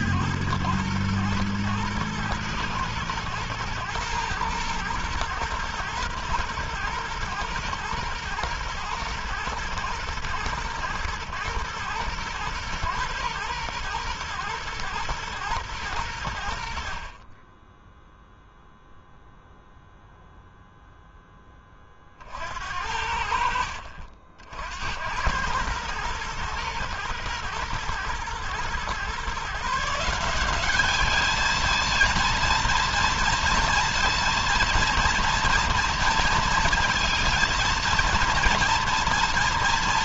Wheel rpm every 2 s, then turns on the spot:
110, 110, 120, 120, 110, 110, 120, 110, 60, 0, 0, 60, 90, 120, 130, 200, 230, 230, 230, 230.
none